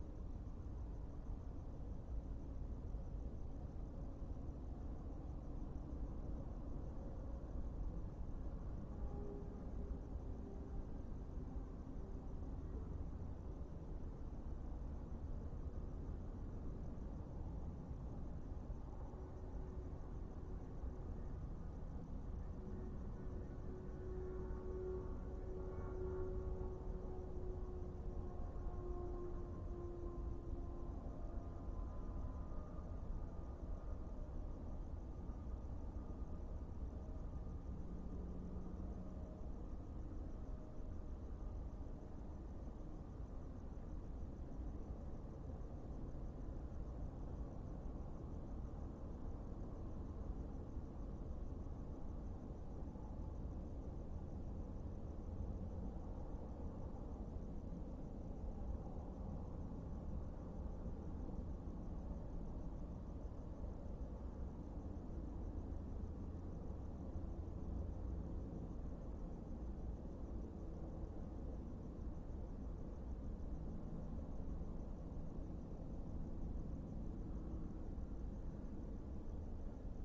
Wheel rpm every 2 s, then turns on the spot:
0, 0, 0, 0, 0, 0, 0, 0, 0, 0, 0, 0, 0, 0, 0, 0, 0, 0, 0, 0, 0, 0, 0, 0, 0, 0, 0, 0, 0, 0, 0, 0, 0, 0, 0, 0, 0, 0, 0, 0.
none